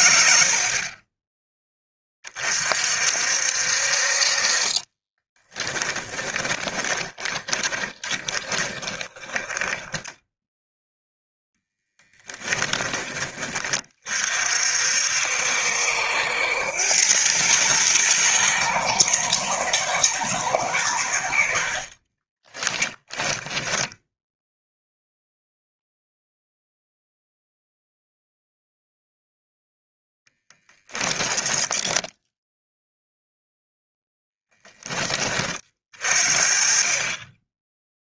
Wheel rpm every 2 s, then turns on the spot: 30, 50, 30, 20, 20, 0, 30, 60, 90, 110, 90, 20, 0, 0, 0, 10, 0, 10, 30.
4-10 22-24 30-32